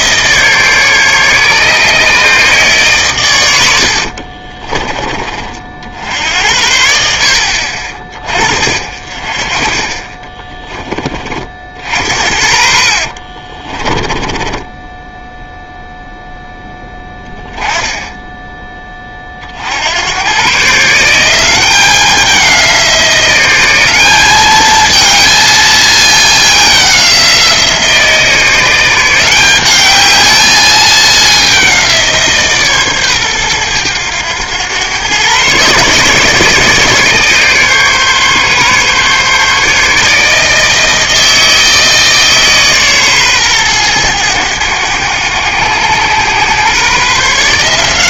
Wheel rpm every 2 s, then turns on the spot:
150, 140, 30, 70, 40, 20, 50, 10, 10, 10, 120, 180, 210, 200, 160, 210, 150, 110, 150, 140, 160, 150, 100, 120.
4-6 10-12 14-16